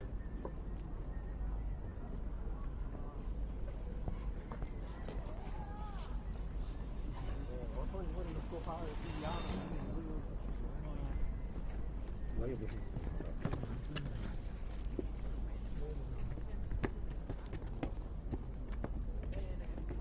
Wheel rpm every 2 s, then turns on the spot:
0, 0, 0, 0, 0, 0, 0, 0, 0, 0.
none